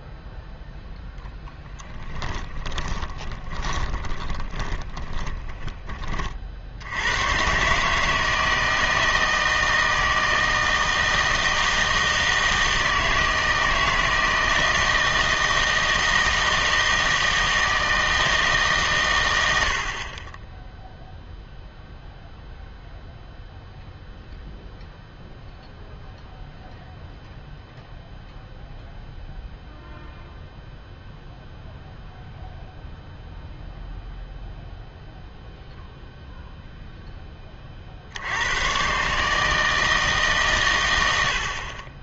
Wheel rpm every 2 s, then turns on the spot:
0, 10, 20, 70, 160, 160, 160, 160, 160, 140, 0, 0, 0, 0, 0, 0, 0, 0, 0, 120, 110.
2-6